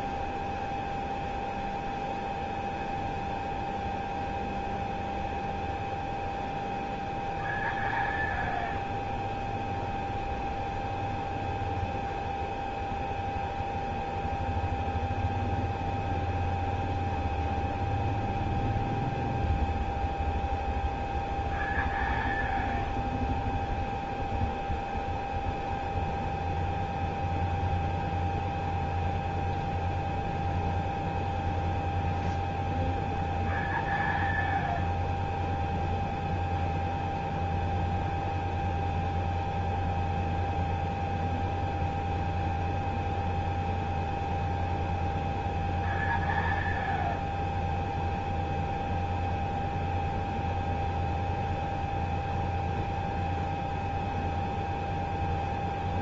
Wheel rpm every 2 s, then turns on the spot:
0, 0, 0, 0, 0, 0, 0, 0, 0, 0, 0, 0, 0, 0, 0, 0, 0, 0, 0, 0, 0, 0, 0, 0, 0, 0, 0, 0.
none